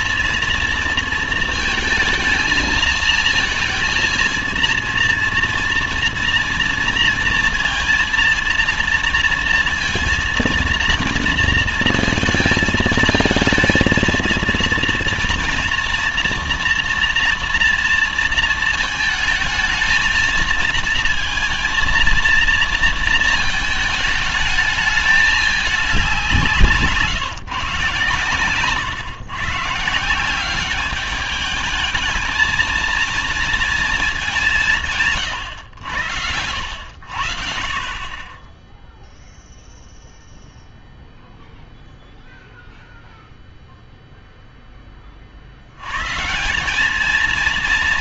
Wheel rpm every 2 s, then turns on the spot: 230, 230, 230, 230, 230, 230, 230, 230, 230, 230, 220, 230, 210, 170, 130, 190, 220, 210, 90, 10, 0, 0, 0, 160.
none